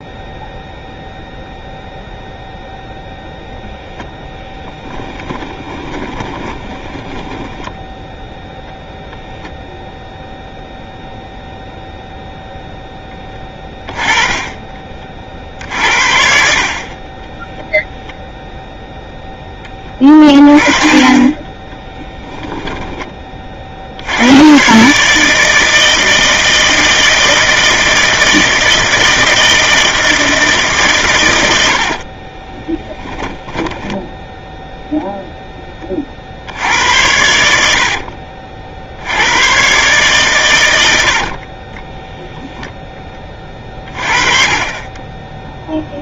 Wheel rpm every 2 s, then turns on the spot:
0, 0, 10, 10, 0, 0, 10, 40, 30, 0, 30, 20, 150, 160, 160, 120, 10, 0, 90, 80, 70, 20, 20.
4-8 32-34 40-42